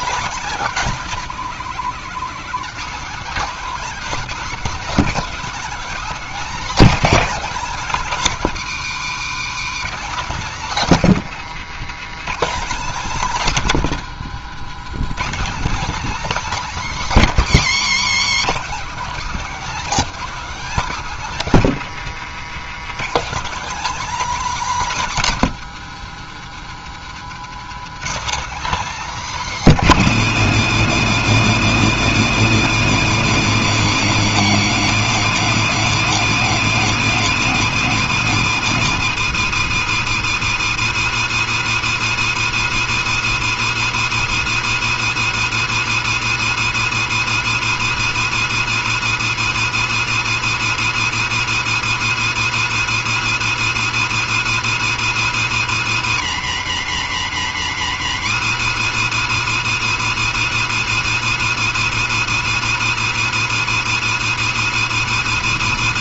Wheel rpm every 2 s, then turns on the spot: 220, 210, 240, 270, 220, 240, 240, 200, 270, 210, 250, 200, 280, 180, 270, 240, 240, 240, 250, 210, 170, 170, 170, 170, 170, 170, 170, 170, 140, 160, 170, 170, 170.
none